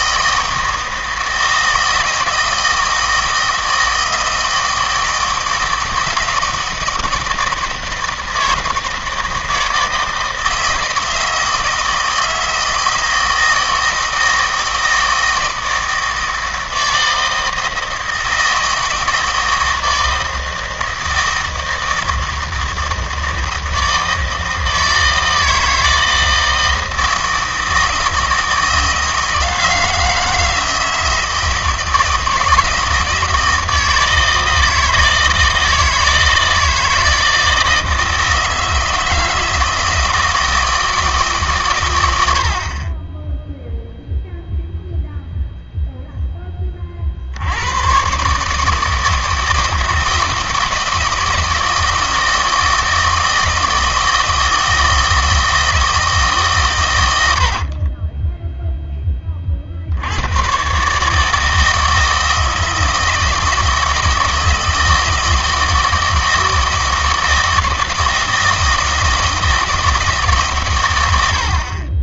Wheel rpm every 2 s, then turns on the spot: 160, 160, 160, 160, 160, 160, 160, 160, 160, 160, 160, 160, 160, 160, 160, 160, 160, 160, 160, 160, 160, 40, 0, 30, 150, 160, 160, 160, 120, 0, 130, 160, 160, 160, 160, 120.
none